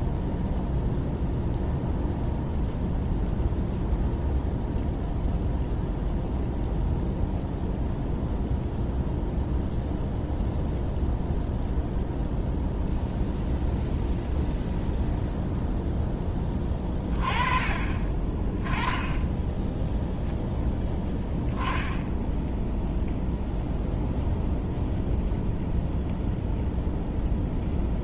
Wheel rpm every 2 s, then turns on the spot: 0, 0, 0, 0, 0, 0, 0, 0, 20, 10, 0, 0, 0, 0.
none